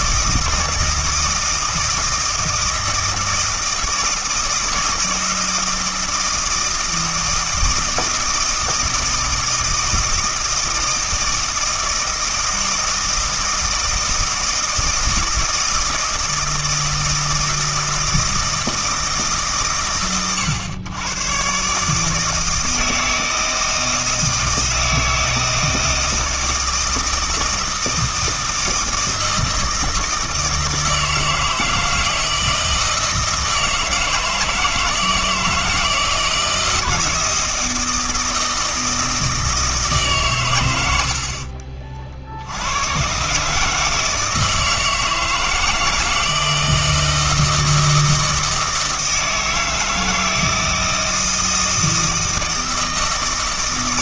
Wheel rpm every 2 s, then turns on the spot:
160, 160, 160, 160, 160, 160, 160, 160, 160, 160, 110, 160, 160, 160, 160, 160, 160, 160, 160, 160, 100, 100, 160, 160, 160, 160, 160.
none